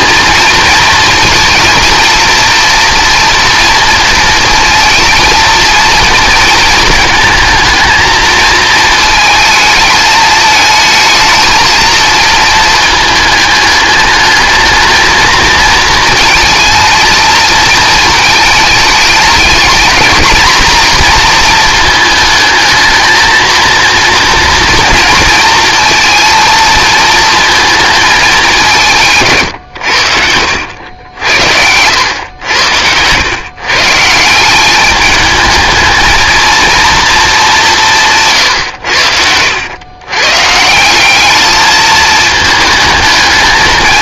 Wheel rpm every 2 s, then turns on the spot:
230, 230, 230, 220, 220, 220, 220, 220, 220, 210, 230, 220, 230, 220, 160, 80, 100, 190, 230, 110, 160, 220.
none